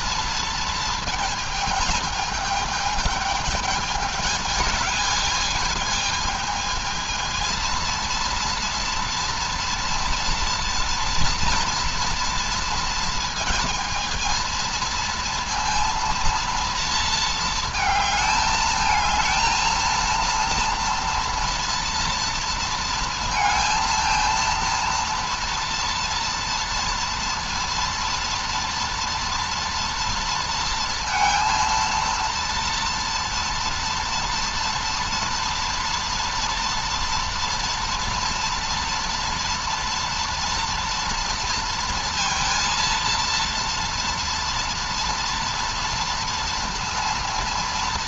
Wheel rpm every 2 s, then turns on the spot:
230, 220, 210, 220, 230, 230, 230, 230, 230, 220, 230, 230, 230, 230, 240, 230, 230, 230, 230, 230, 240, 230, 230, 230.
none